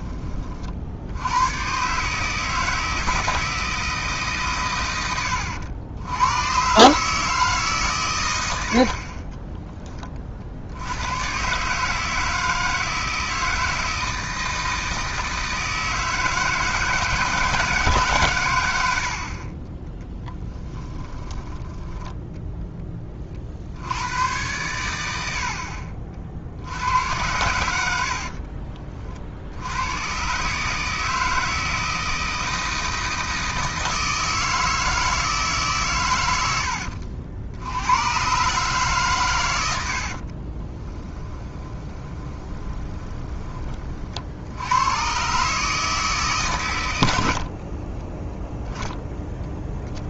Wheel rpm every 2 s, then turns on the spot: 50, 160, 120, 120, 80, 70, 160, 160, 160, 90, 10, 10, 90, 80, 40, 150, 160, 160, 80, 140, 30, 20, 90, 120, 0.
8-10 20-22 28-30 40-44